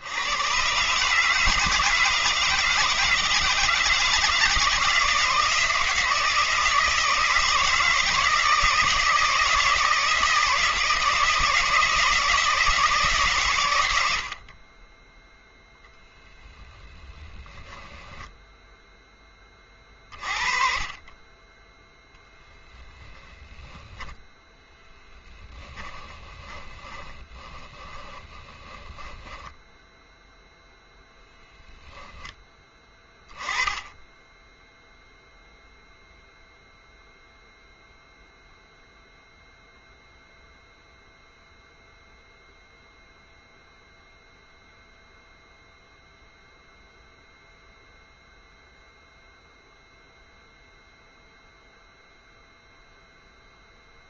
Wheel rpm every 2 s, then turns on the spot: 130, 160, 160, 160, 160, 160, 160, 30, 20, 0, 40, 10, 10, 30, 10, 0, 10, 10, 0, 0, 0, 0, 0, 0, 0, 0, 0.
16-18 24-30